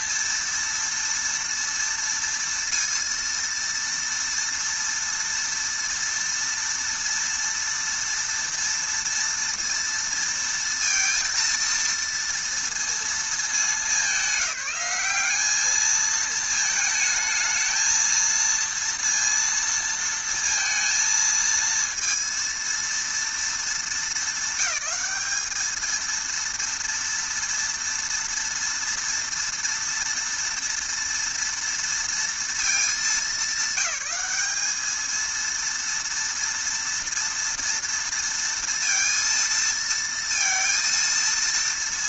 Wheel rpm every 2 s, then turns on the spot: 230, 230, 230, 230, 230, 230, 230, 190, 220, 230, 230, 230, 200, 230, 240, 230, 220, 220, 230, 230, 230.
none